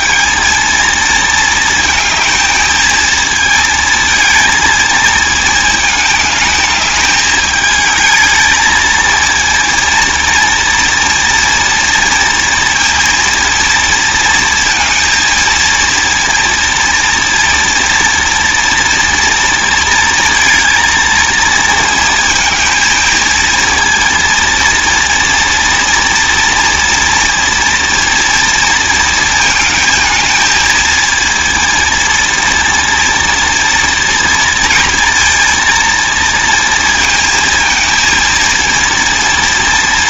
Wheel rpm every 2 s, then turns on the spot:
220, 220, 220, 220, 220, 230, 230, 230, 230, 230, 220, 220, 230, 230, 230, 230, 230, 230, 230, 230.
none